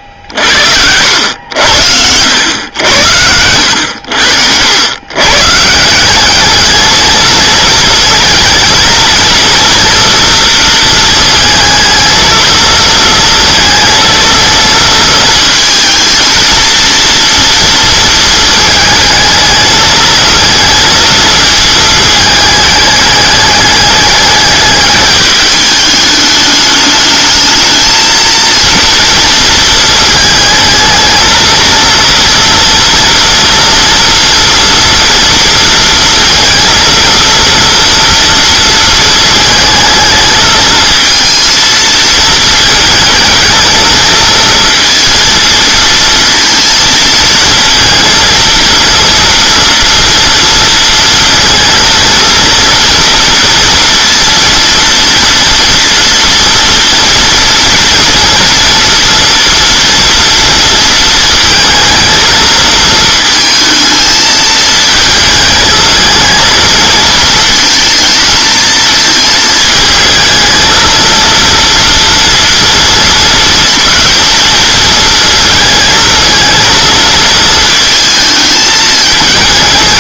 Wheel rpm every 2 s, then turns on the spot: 70, 90, 80, 210, 220, 230, 230, 230, 230, 220, 230, 210, 210, 210, 230, 220, 230, 240, 230, 230, 220, 220, 230, 230, 230, 230, 240, 230, 230, 230, 230, 230, 220, 220, 220, 230, 230, 230, 220, 220.
none